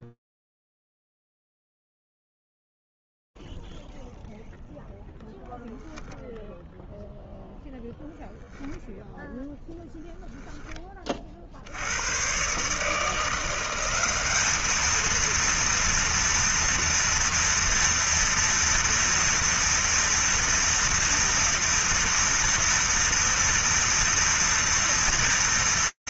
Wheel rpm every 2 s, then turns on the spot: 0, 0, 0, 0, 0, 10, 130, 210, 230, 230, 230, 230, 240.
none